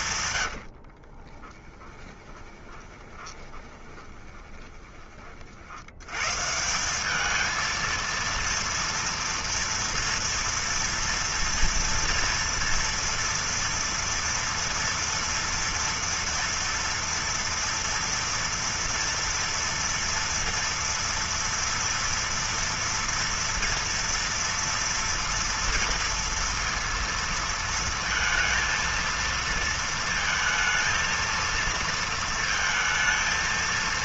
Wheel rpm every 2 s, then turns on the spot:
80, 20, 20, 150, 230, 230, 240, 230, 240, 240, 230, 230, 230, 230, 230, 230, 230.
0-6